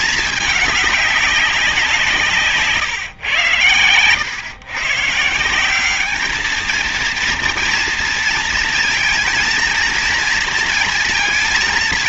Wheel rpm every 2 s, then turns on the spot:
210, 130, 120, 220, 230, 230.
none